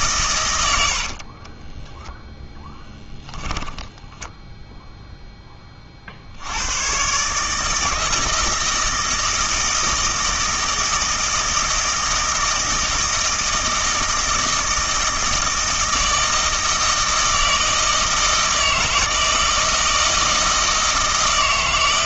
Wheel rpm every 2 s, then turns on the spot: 90, 10, 0, 100, 160, 160, 160, 160, 160, 160, 160.
none